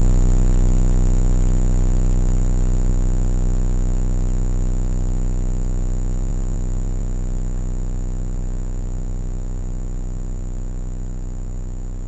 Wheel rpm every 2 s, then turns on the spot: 0, 0, 0, 0, 0, 0.
none